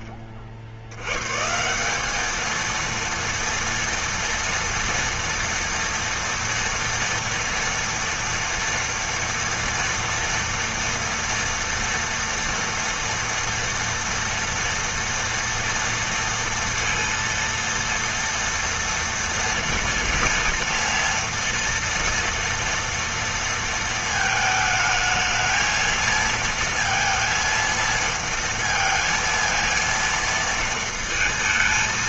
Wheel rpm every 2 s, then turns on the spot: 70, 230, 230, 240, 230, 230, 230, 230, 230, 230, 230, 230, 220, 230, 230, 220.
none